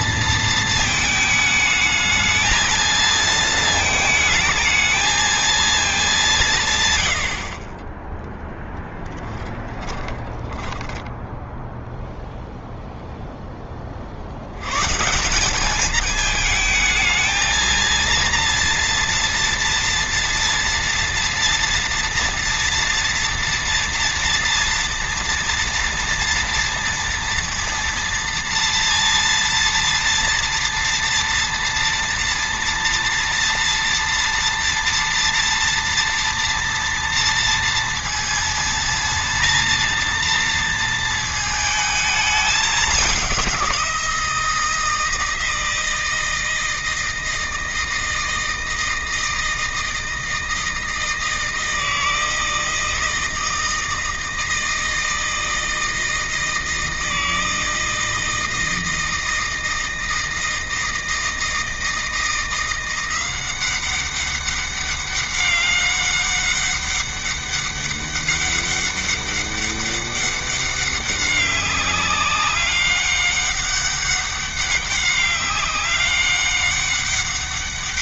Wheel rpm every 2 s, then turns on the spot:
220, 220, 220, 110, 10, 10, 0, 140, 220, 230, 230, 240, 230, 230, 230, 230, 230, 230, 230, 230, 230, 200, 170, 160, 160, 160, 160, 160, 160, 160, 160, 180, 200, 200, 200, 200, 200, 200, 200.
10-12